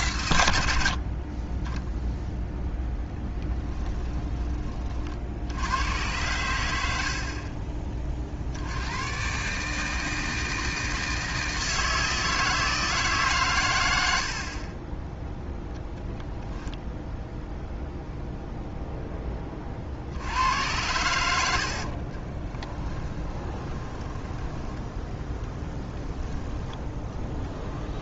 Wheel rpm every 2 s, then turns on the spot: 90, 0, 20, 90, 90, 160, 160, 40, 0, 0, 100, 20, 10, 10.
22-24 26-28